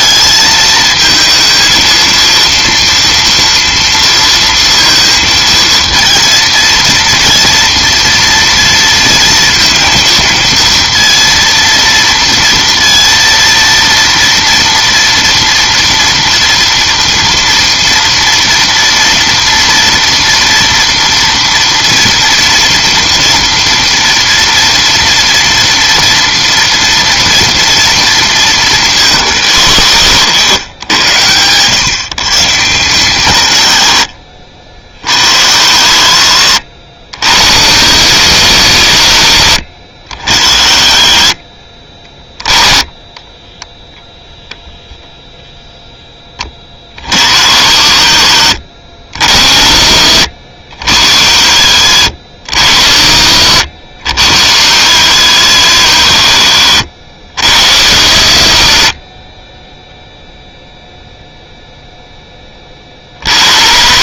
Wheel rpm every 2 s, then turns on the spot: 220, 230, 230, 230, 230, 230, 230, 230, 230, 230, 240, 240, 230, 230, 200, 100, 150, 60, 70, 100, 60, 10, 10, 30, 70, 70, 70, 90, 60, 60, 0, 10.
none